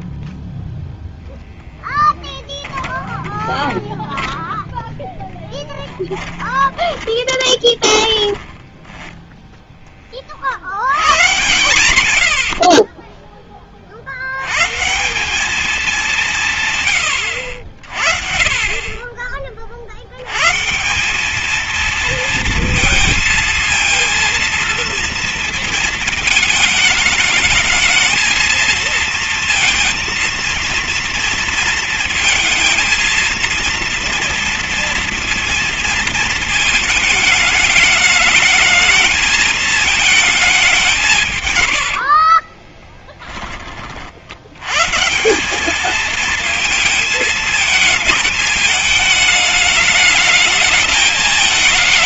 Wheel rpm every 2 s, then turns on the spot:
0, 20, 10, 10, 10, 60, 60, 130, 140, 30, 140, 220, 230, 210, 230, 230, 220, 230, 220, 210, 200, 20, 100, 220, 210, 210.
2-4 6-10 42-44